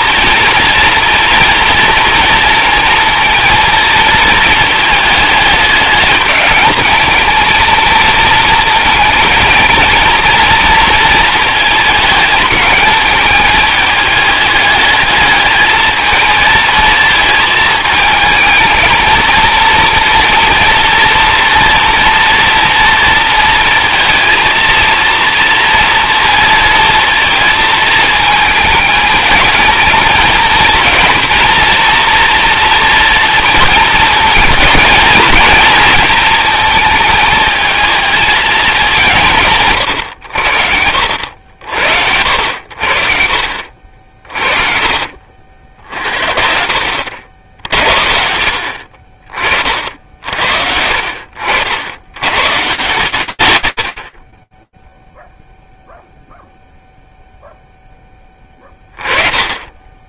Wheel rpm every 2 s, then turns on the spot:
230, 230, 220, 210, 230, 230, 220, 210, 220, 220, 230, 230, 230, 230, 220, 220, 230, 220, 220, 220, 70, 80, 40, 50, 60, 60, 120, 20, 0, 20.
48-52